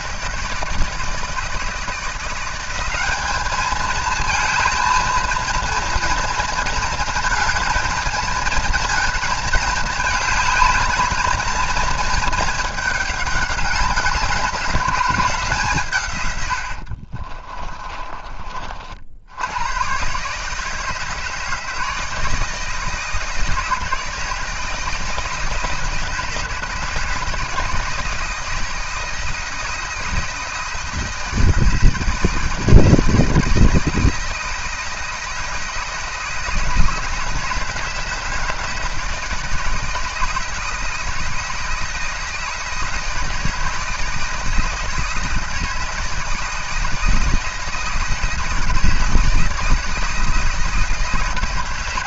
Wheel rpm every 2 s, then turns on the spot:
160, 200, 220, 230, 230, 220, 210, 190, 80, 50, 150, 160, 160, 160, 160, 160, 160, 160, 160, 160, 160, 160, 160, 160, 160, 150.
16-18